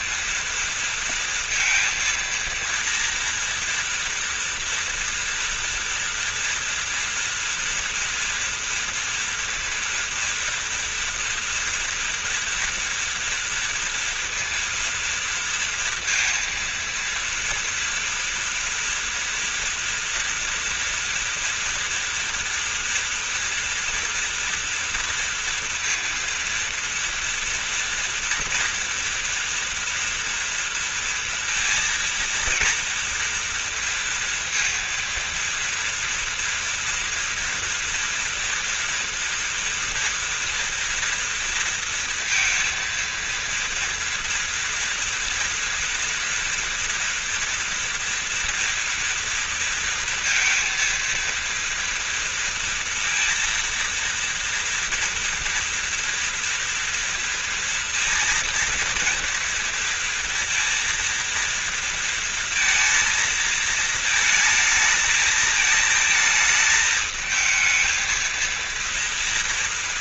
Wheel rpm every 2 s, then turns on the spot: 230, 230, 230, 230, 240, 230, 240, 230, 230, 230, 240, 240, 230, 230, 230, 230, 230, 230, 230, 230, 230, 230, 240, 230, 230, 230, 230, 230, 230, 230, 230, 230, 220, 220, 230.
none